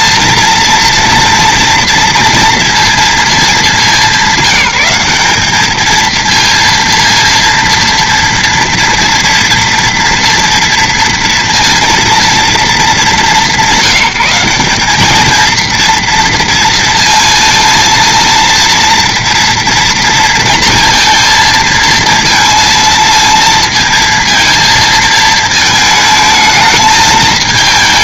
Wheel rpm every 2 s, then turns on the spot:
230, 230, 190, 230, 230, 230, 220, 200, 230, 230, 230, 230, 230, 220.
none